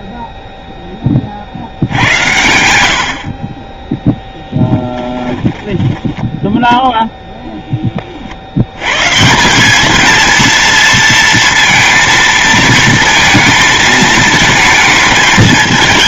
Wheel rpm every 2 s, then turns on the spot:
10, 80, 10, 0, 90, 230, 230, 220.
4-6